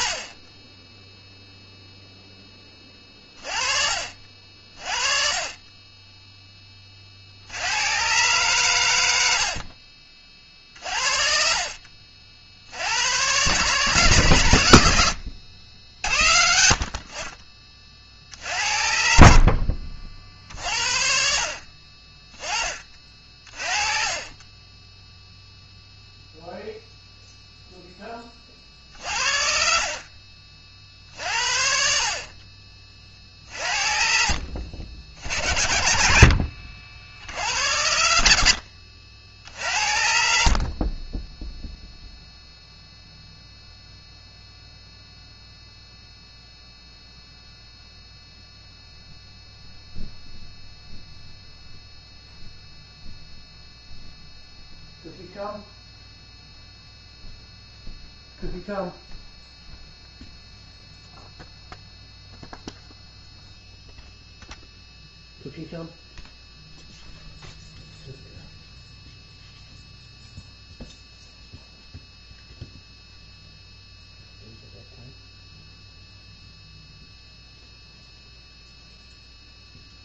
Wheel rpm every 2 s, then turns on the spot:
20, 30, 30, 110, 40, 70, 110, 70, 60, 50, 20, 20, 0, 20, 40, 40, 50, 60, 80, 60, 0, 0, 0, 0, 0, 0, 0, 0, 0, 0, 0, 0, 0, 0, 0, 0, 0, 0, 0, 0.
16-18 22-24 34-36 38-40